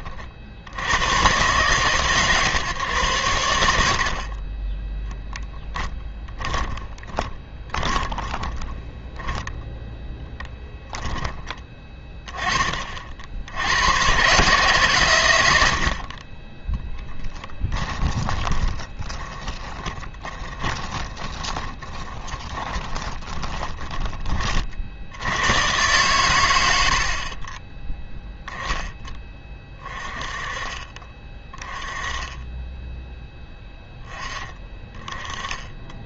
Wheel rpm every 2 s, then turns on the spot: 60, 130, 20, 10, 10, 10, 20, 130, 20, 20, 20, 20, 40, 100, 10, 30, 10, 20.
6-10 18-24